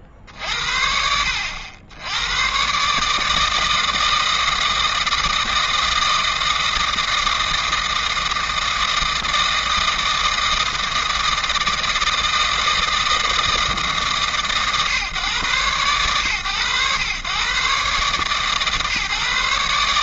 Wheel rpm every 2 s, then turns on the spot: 50, 120, 160, 160, 160, 160, 160, 120, 110, 140.
none